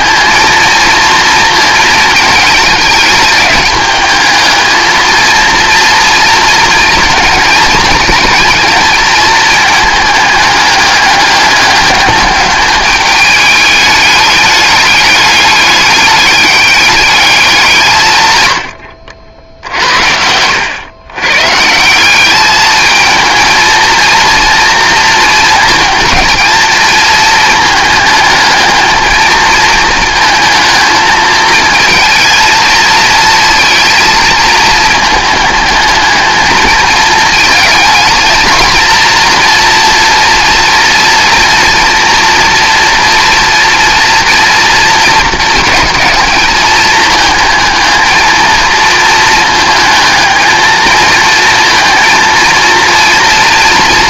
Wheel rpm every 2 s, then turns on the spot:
230, 210, 220, 230, 230, 210, 210, 210, 200, 100, 90, 210, 230, 220, 220, 220, 230, 220, 220, 230, 230, 240, 230, 210, 220, 220, 230.
18-20